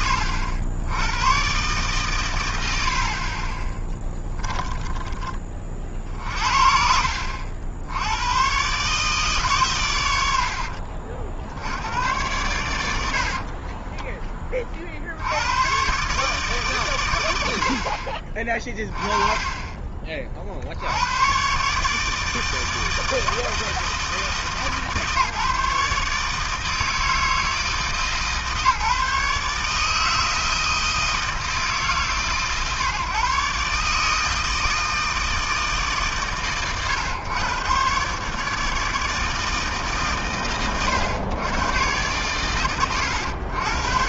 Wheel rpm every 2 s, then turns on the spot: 80, 80, 20, 70, 140, 70, 50, 90, 80, 30, 120, 160, 150, 160, 150, 160, 140, 150, 120, 160, 110, 120.
2-4 12-14 18-20